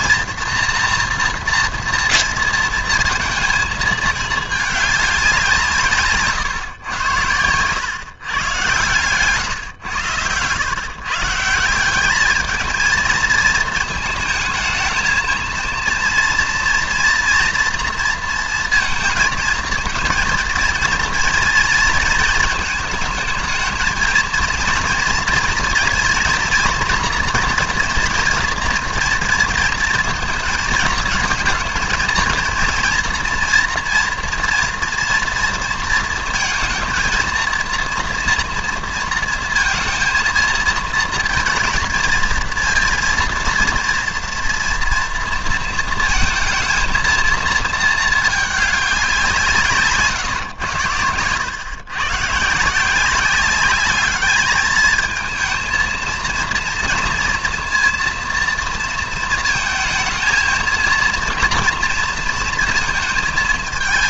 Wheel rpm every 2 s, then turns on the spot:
230, 230, 210, 130, 130, 120, 220, 220, 230, 230, 230, 220, 230, 230, 230, 220, 230, 230, 230, 230, 230, 230, 230, 230, 210, 110, 160, 220, 230, 230, 220, 230.
none